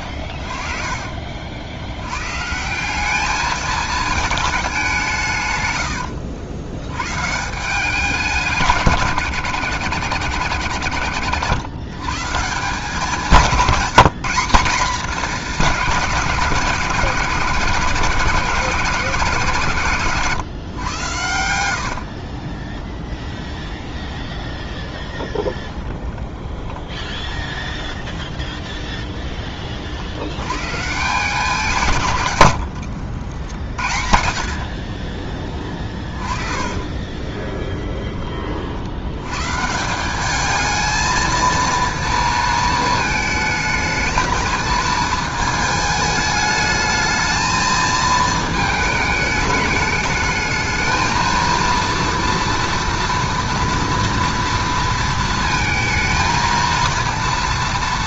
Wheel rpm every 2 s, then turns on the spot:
50, 160, 210, 100, 170, 70, 150, 190, 160, 160, 130, 20, 20, 20, 20, 110, 90, 50, 30, 40, 210, 220, 220, 220, 220, 220, 230, 230, 230.
22-30 32-38